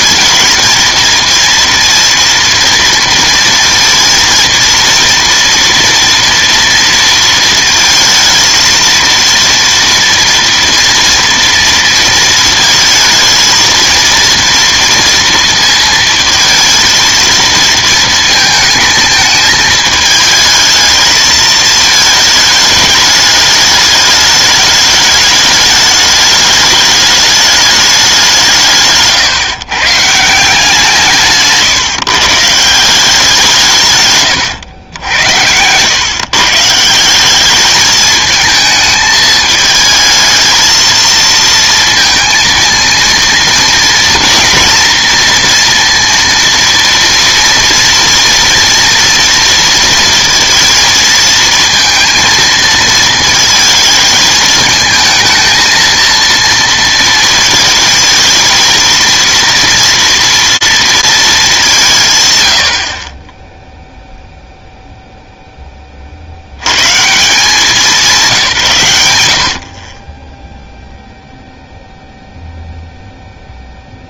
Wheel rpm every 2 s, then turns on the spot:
230, 230, 230, 230, 220, 230, 220, 230, 230, 220, 220, 220, 210, 210, 160, 170, 160, 120, 150, 220, 220, 230, 230, 230, 230, 230, 230, 220, 230, 220, 230, 90, 0, 100, 140, 0, 0.
none